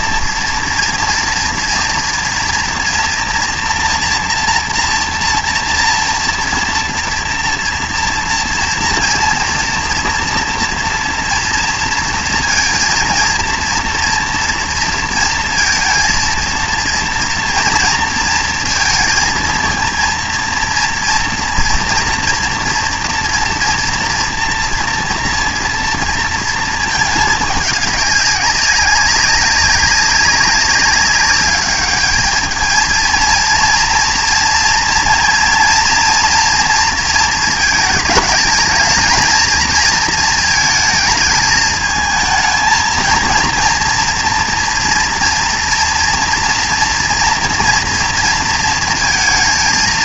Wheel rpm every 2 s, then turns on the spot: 230, 230, 230, 230, 230, 230, 230, 230, 230, 230, 230, 230, 240, 220, 200, 200, 220, 230, 230, 220, 220, 230, 230, 240, 230.
none